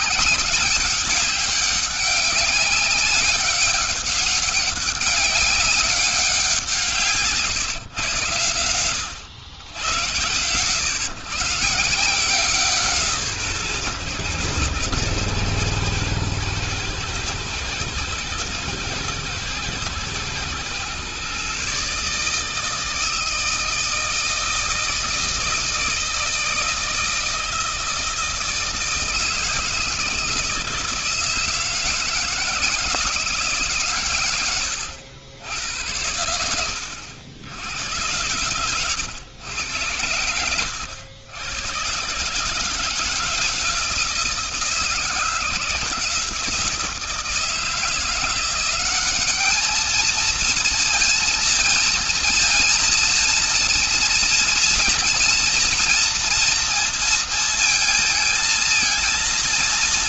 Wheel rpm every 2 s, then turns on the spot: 200, 200, 200, 170, 100, 100, 170, 120, 110, 110, 110, 150, 160, 160, 160, 160, 170, 110, 90, 120, 90, 150, 160, 170, 180, 230, 230, 230, 230, 220.
none